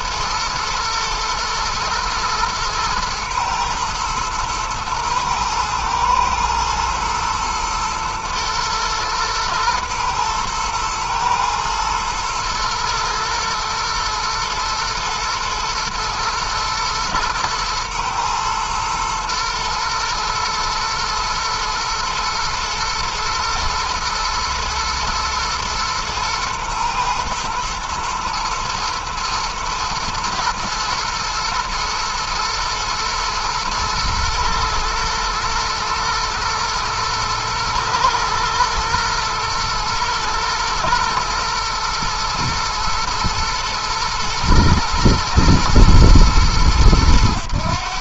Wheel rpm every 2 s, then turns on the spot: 110, 110, 110, 110, 120, 120, 120, 110, 110, 120, 120, 120, 120, 120, 110, 110, 110, 110, 120, 120, 120, 110, 120, 100.
none